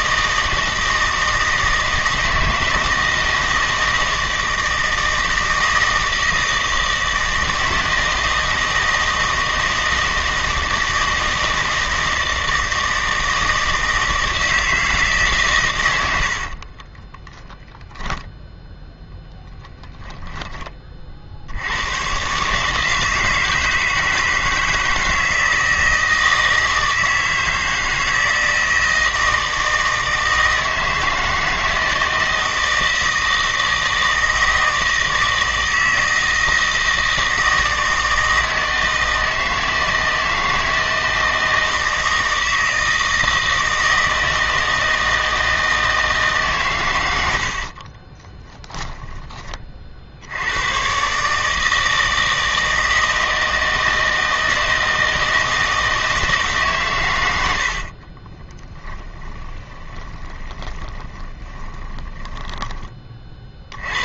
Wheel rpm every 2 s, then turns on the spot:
160, 160, 160, 160, 160, 160, 160, 160, 40, 0, 20, 150, 160, 160, 160, 160, 160, 160, 160, 160, 160, 160, 160, 130, 10, 110, 160, 160, 140, 20, 30, 20.
16-18 48-50 58-64